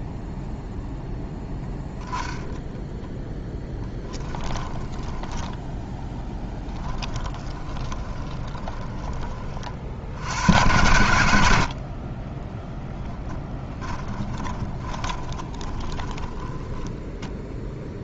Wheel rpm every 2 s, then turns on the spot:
0, 10, 10, 10, 20, 90, 10, 20, 10.
4-10 12-18